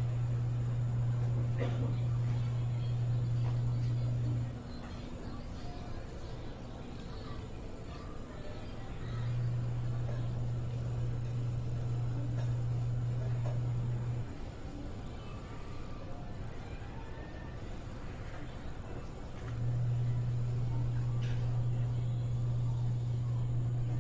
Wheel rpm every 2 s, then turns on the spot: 0, 0, 0, 0, 0, 0, 0, 0, 0, 0, 0, 0.
none